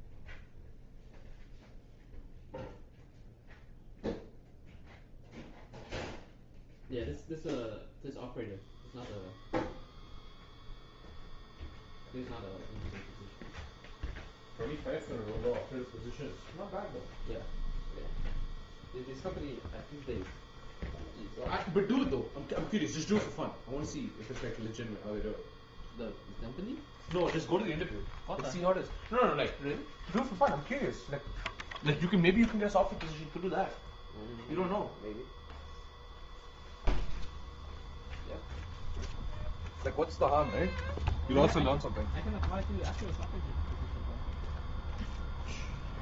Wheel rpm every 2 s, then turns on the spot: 0, 0, 0, 0, 0, 0, 0, 0, 0, 0, 0, 0, 0, 0, 0, 0, 0, 0, 0, 0, 0, 0, 0.
none